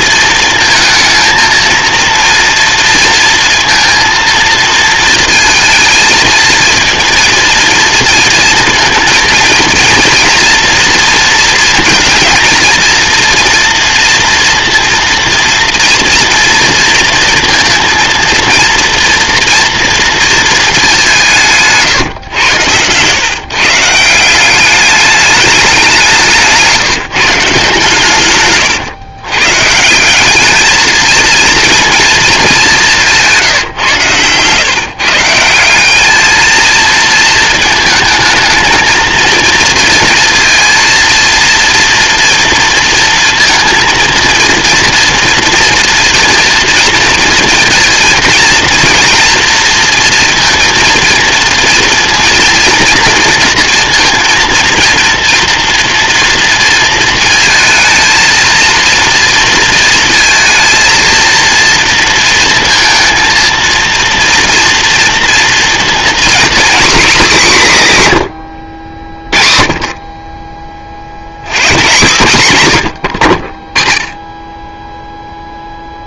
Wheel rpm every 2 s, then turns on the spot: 220, 230, 220, 230, 230, 230, 230, 230, 230, 230, 190, 110, 200, 160, 130, 220, 170, 170, 230, 230, 230, 230, 240, 230, 230, 230, 230, 230, 230, 230, 230, 230, 230, 250, 50, 70, 70, 0.
32-34